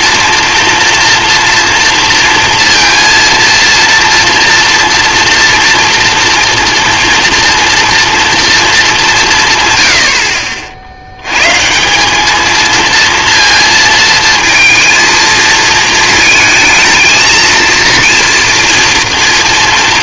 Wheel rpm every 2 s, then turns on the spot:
230, 230, 230, 230, 220, 60, 220, 230, 220, 240.
none